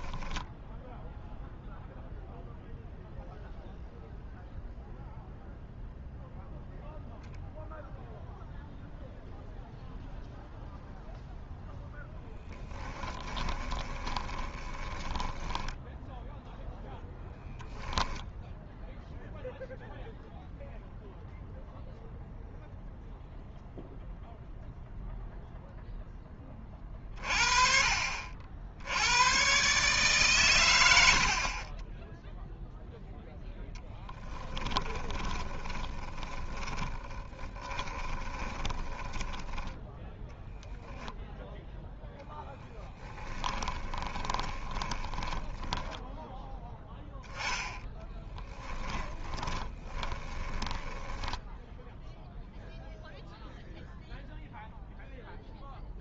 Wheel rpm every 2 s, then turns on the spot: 10, 0, 0, 0, 0, 0, 10, 20, 0, 0, 0, 0, 0, 20, 70, 120, 0, 20, 20, 20, 0, 0, 10, 10, 20, 10, 0, 0.
0-2 12-16 34-40 44-52